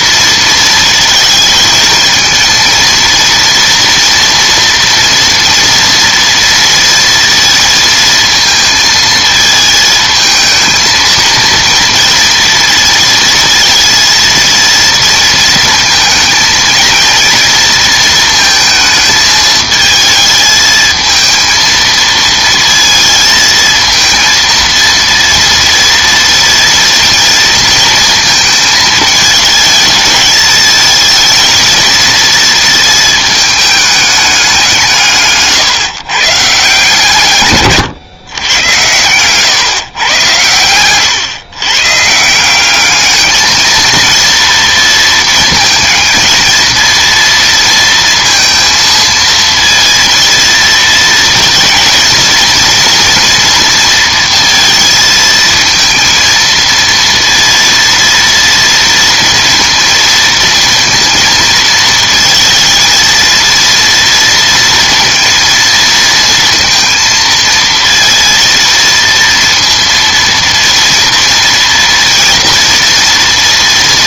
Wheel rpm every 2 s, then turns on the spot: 230, 230, 240, 230, 220, 220, 230, 230, 220, 220, 220, 230, 230, 240, 220, 220, 230, 180, 160, 110, 110, 200, 230, 230, 230, 230, 240, 230, 230, 230, 230, 230, 230, 230, 230, 230, 230.
none